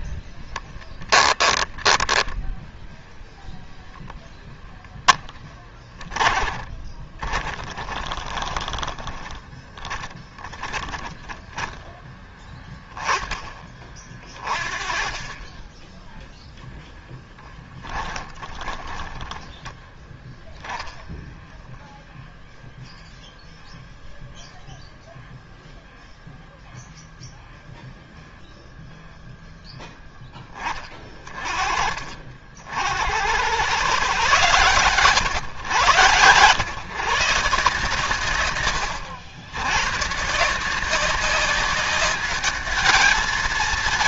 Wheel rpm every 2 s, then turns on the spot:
10, 0, 10, 20, 20, 10, 10, 20, 10, 20, 0, 0, 0, 0, 0, 20, 70, 130, 150, 120, 180, 220.
0-2 6-12 16-20